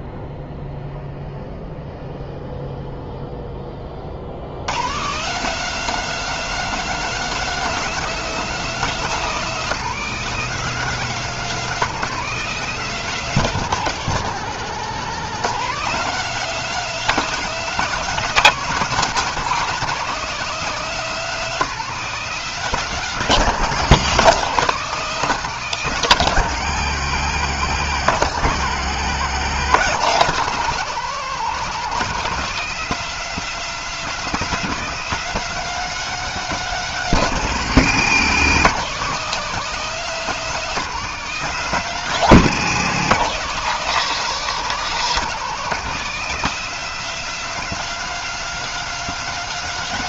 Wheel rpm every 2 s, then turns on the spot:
0, 0, 110, 210, 210, 210, 200, 170, 210, 210, 200, 200, 190, 180, 160, 190, 200, 210, 200, 180, 200, 190, 190, 200, 210.
none